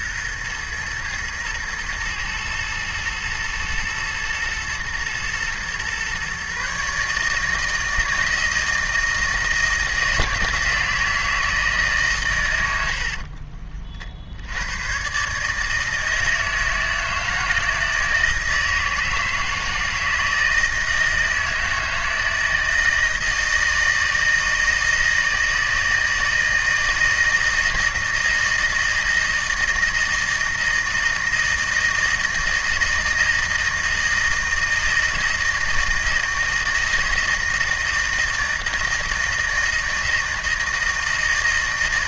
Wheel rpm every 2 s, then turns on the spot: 110, 120, 120, 140, 160, 170, 90, 90, 160, 160, 160, 160, 160, 160, 160, 160, 160, 160, 160, 160, 160.
none